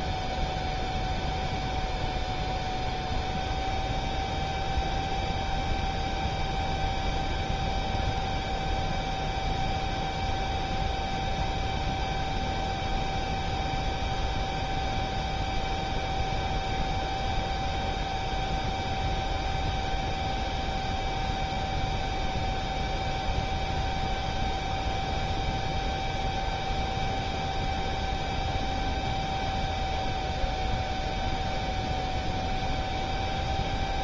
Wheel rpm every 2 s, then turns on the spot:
0, 0, 0, 0, 0, 0, 0, 0, 0, 0, 0, 0, 0, 0, 0, 0, 0.
none